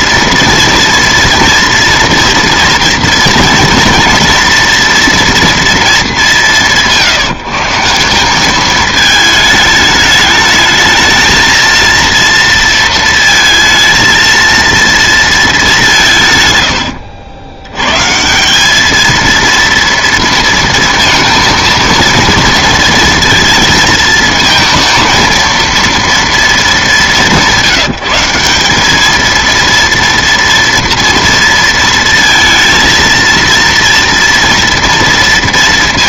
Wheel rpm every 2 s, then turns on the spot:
230, 230, 230, 170, 210, 220, 230, 230, 110, 190, 220, 230, 230, 220, 190, 230, 230, 230.
none